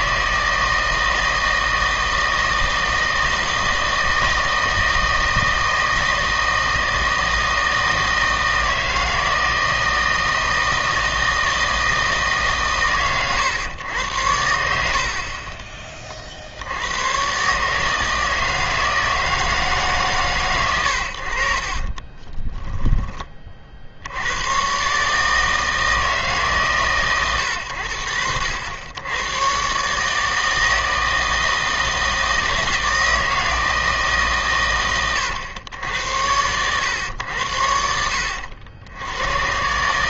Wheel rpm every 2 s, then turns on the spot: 160, 160, 160, 160, 160, 160, 140, 80, 80, 160, 110, 20, 120, 140, 80, 160, 160, 120, 90, 90.
14-16 22-24